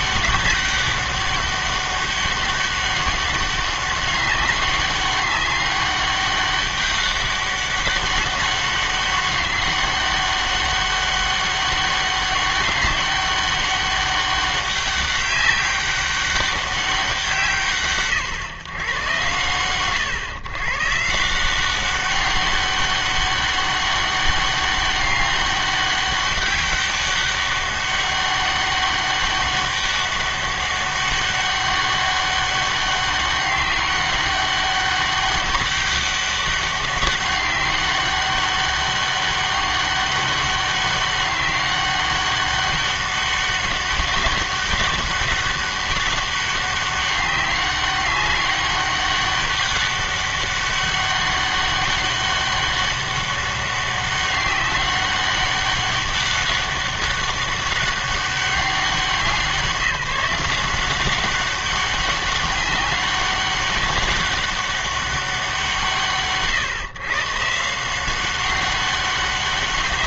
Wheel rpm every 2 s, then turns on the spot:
200, 200, 200, 200, 200, 200, 200, 190, 200, 140, 130, 200, 200, 200, 200, 200, 200, 200, 200, 200, 200, 200, 200, 200, 200, 200, 200, 200, 200, 190, 170, 190, 200, 140, 190.
none